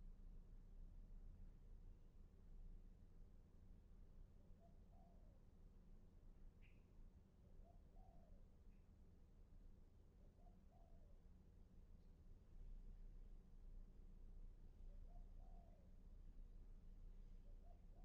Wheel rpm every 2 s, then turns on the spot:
0, 0, 0, 0, 0, 0, 0, 0, 0.
none